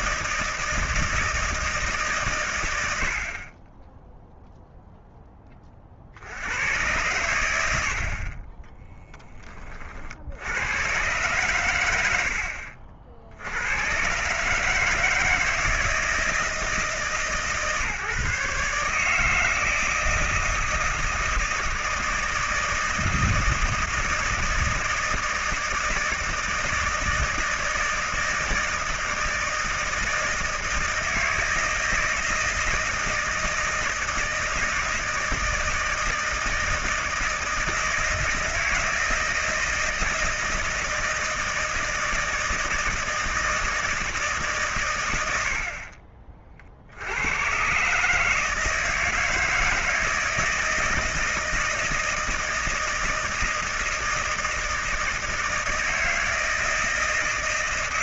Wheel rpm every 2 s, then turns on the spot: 160, 110, 0, 90, 30, 90, 60, 140, 160, 150, 160, 160, 160, 160, 160, 160, 160, 160, 160, 160, 160, 160, 150, 50, 160, 160, 160, 160, 160.
none